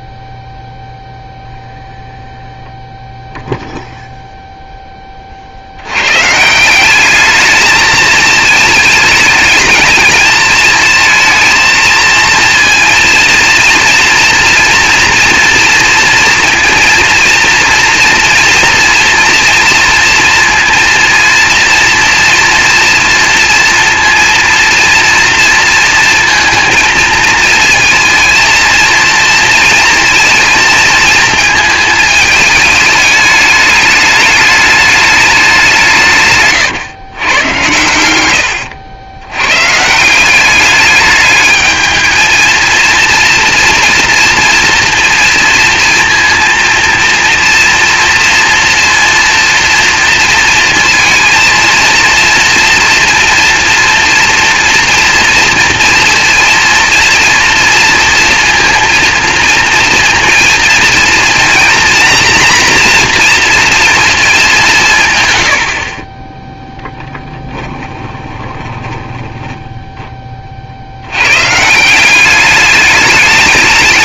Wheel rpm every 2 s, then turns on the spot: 0, 0, 0, 170, 220, 220, 240, 230, 230, 230, 230, 230, 230, 230, 230, 230, 210, 210, 140, 90, 200, 230, 230, 230, 230, 230, 230, 230, 230, 230, 230, 240, 190, 10, 10, 40, 200.
68-70